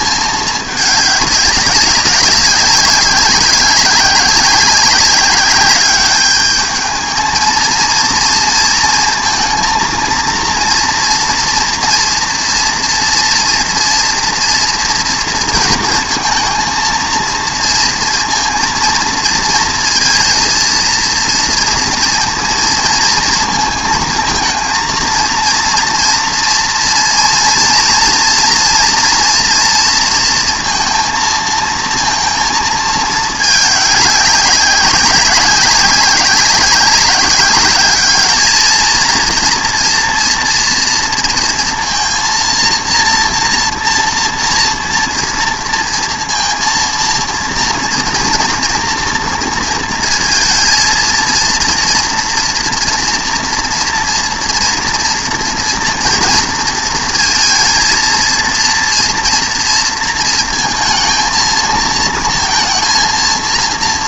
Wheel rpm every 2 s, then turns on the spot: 210, 200, 190, 220, 230, 230, 230, 240, 230, 230, 230, 230, 230, 230, 230, 230, 220, 200, 200, 230, 230, 230, 230, 230, 230, 230, 240, 240, 220, 230, 230, 230.
none